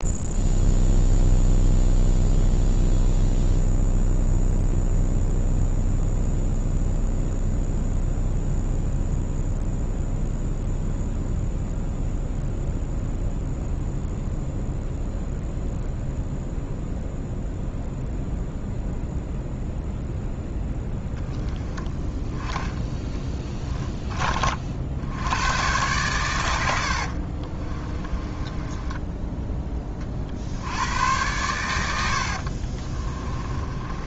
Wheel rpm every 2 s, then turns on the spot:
0, 0, 0, 0, 0, 0, 0, 0, 0, 0, 0, 10, 40, 90, 20, 80, 40.
28-30 32-34